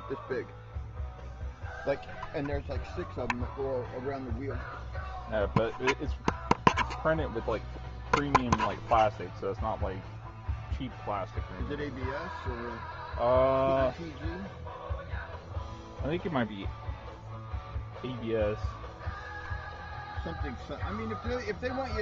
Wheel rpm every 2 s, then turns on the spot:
0, 0, 0, 0, 0, 0, 0, 0, 0, 0, 0.
none